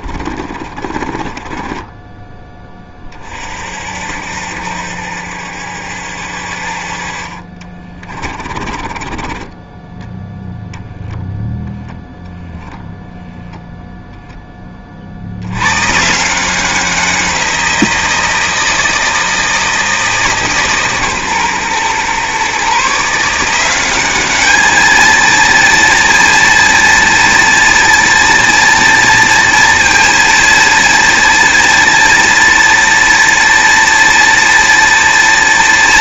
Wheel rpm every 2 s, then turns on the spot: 30, 20, 70, 50, 30, 0, 0, 30, 180, 160, 140, 140, 220, 230, 230, 230, 230, 230.
0-2 8-10